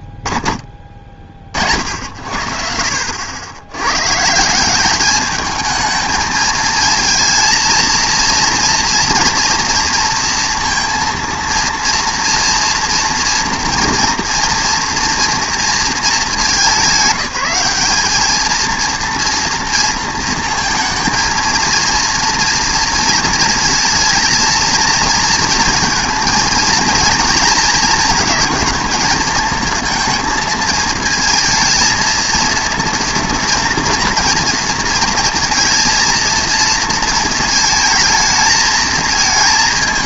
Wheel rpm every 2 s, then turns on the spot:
40, 60, 180, 220, 230, 230, 230, 230, 200, 230, 230, 240, 230, 230, 230, 220, 230, 230, 230, 220.
none